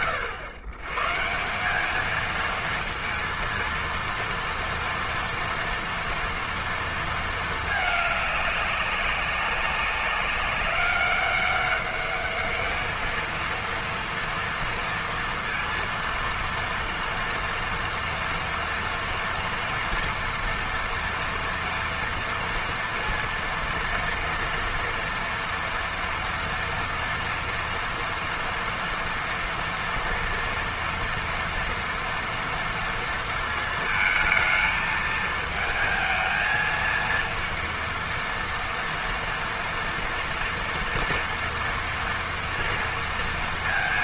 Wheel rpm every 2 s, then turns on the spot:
120, 230, 230, 220, 200, 200, 220, 230, 240, 230, 230, 230, 230, 230, 230, 230, 230, 220, 230, 230, 230, 230.
none